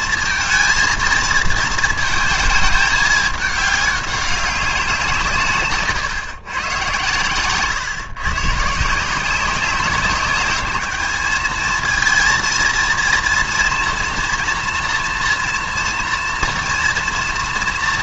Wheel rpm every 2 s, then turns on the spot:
230, 220, 190, 120, 150, 200, 230, 230, 230.
none